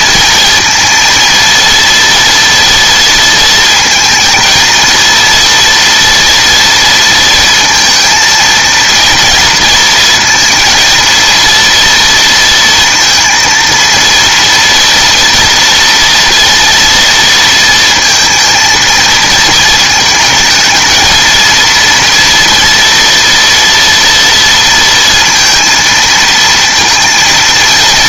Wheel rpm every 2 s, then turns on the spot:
230, 230, 230, 230, 230, 230, 230, 230, 230, 230, 220, 230, 230, 230.
none